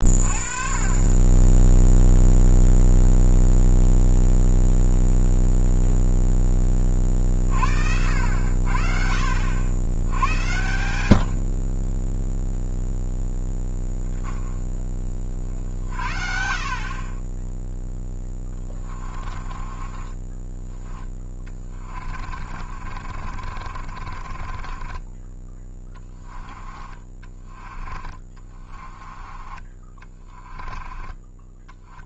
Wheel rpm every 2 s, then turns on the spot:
30, 0, 0, 20, 50, 100, 0, 30, 40, 20, 20, 40, 20, 20, 30, 20.
18-20 22-26 28-32